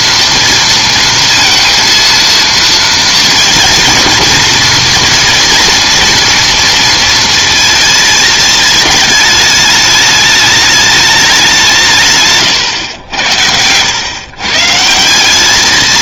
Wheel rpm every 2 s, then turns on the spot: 230, 230, 240, 230, 220, 210, 100, 160.
none